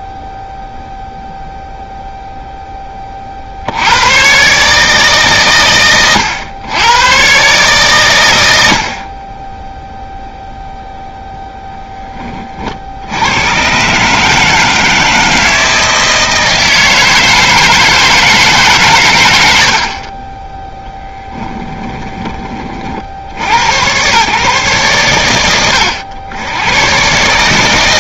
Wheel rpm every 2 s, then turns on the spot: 0, 10, 140, 110, 70, 0, 60, 160, 160, 130, 10, 20, 110, 110.
20-22